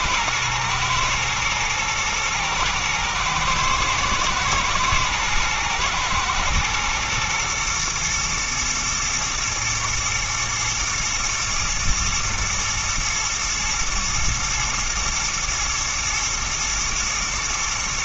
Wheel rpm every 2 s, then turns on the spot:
110, 110, 110, 120, 110, 120, 110, 120, 110.
none